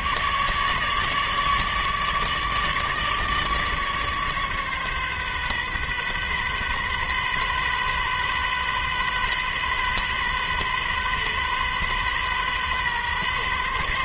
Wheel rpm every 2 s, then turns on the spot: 150, 150, 140, 130, 130, 130, 130.
none